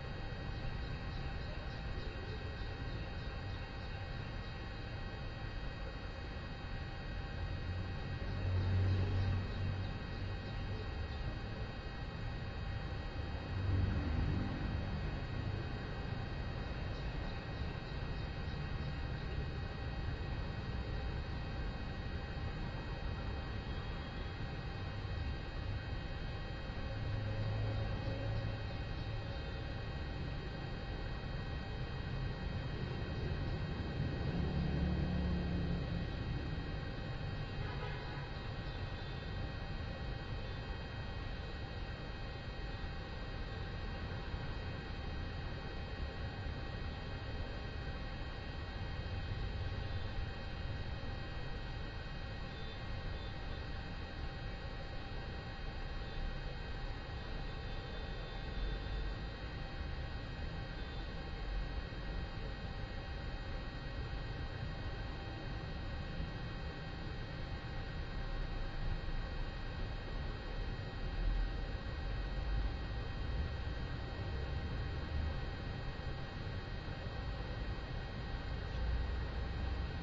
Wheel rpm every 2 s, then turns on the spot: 0, 0, 0, 0, 0, 0, 0, 0, 0, 0, 0, 0, 0, 0, 0, 0, 0, 0, 0, 0, 0, 0, 0, 0, 0, 0, 0, 0, 0, 0, 0, 0, 0, 0, 0, 0, 0, 0, 0, 0.
none